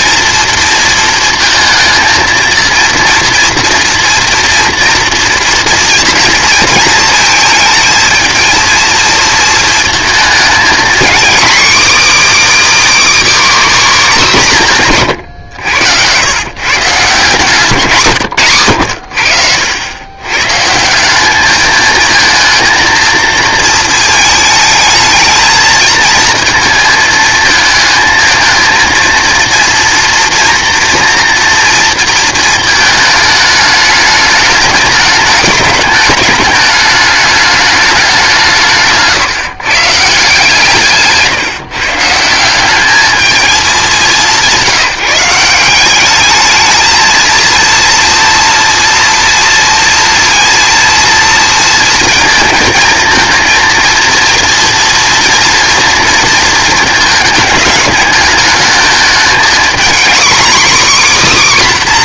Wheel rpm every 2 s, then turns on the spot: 230, 230, 230, 230, 230, 240, 310, 170, 140, 110, 150, 230, 220, 230, 230, 230, 220, 210, 210, 170, 150, 190, 160, 220, 240, 230, 220, 240, 220, 220, 270.
none